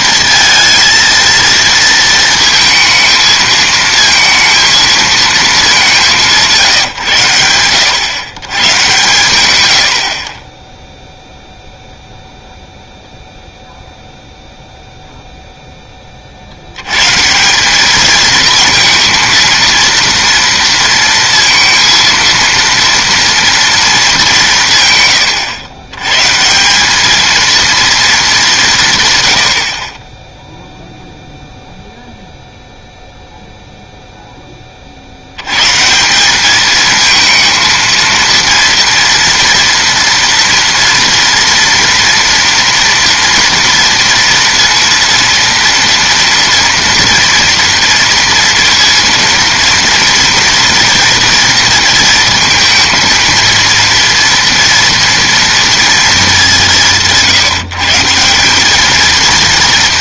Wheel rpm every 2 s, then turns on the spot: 230, 220, 230, 160, 130, 10, 0, 0, 80, 230, 230, 230, 190, 160, 170, 0, 0, 30, 210, 230, 230, 230, 230, 230, 230, 230, 230, 230, 170, 210.
none